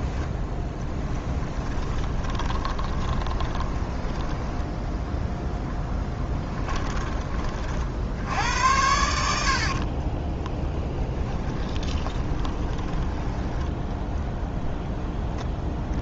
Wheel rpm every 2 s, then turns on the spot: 10, 20, 10, 20, 90, 20, 10, 10.
0-4 6-8 10-14